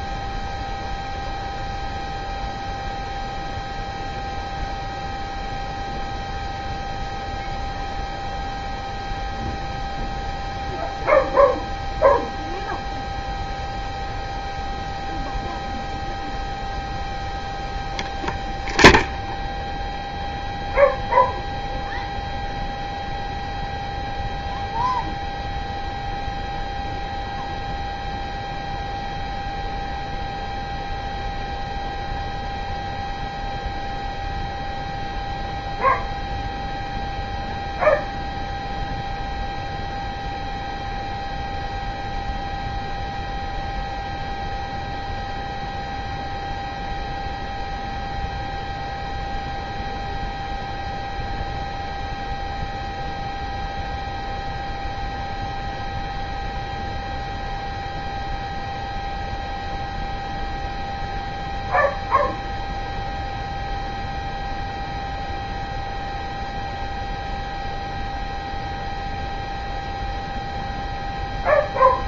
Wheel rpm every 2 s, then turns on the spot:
0, 0, 0, 0, 0, 0, 0, 0, 0, 0, 0, 0, 0, 0, 0, 0, 0, 0, 0, 0, 0, 0, 0, 0, 0, 0, 0, 0, 0, 0, 0, 0, 0, 0, 0, 0.
none